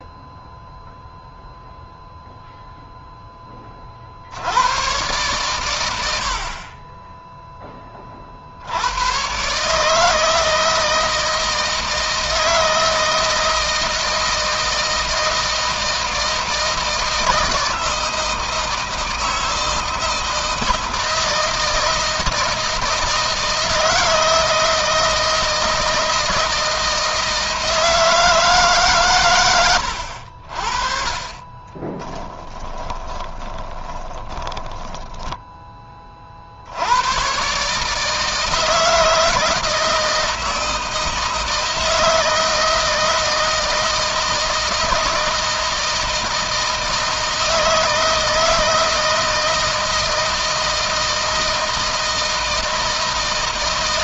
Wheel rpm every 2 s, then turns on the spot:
0, 0, 110, 30, 100, 160, 160, 160, 160, 160, 160, 160, 160, 160, 130, 40, 20, 10, 90, 160, 160, 160, 160, 160, 160, 160, 160.
32-36